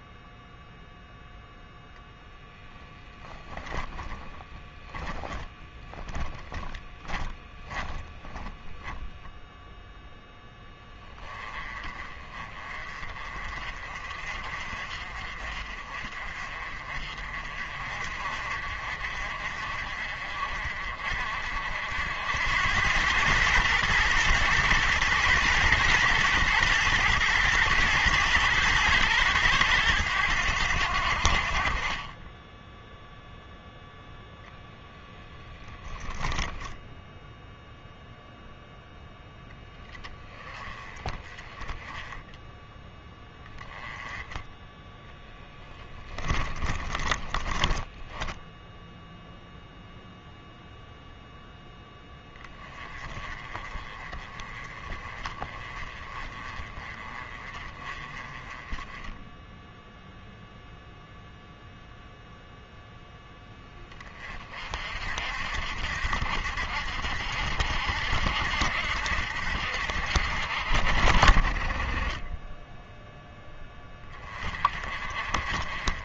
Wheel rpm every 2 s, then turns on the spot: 0, 0, 10, 30, 10, 10, 30, 40, 40, 50, 50, 100, 120, 110, 110, 70, 0, 0, 0, 0, 20, 10, 10, 20, 0, 0, 20, 30, 30, 10, 0, 0, 50, 70, 70, 50, 0, 40.
4-8 44-48